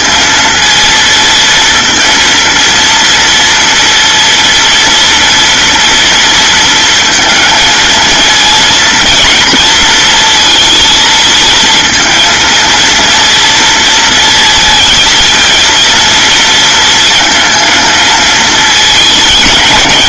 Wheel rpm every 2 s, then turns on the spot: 230, 230, 230, 230, 230, 230, 230, 220, 220, 220.
none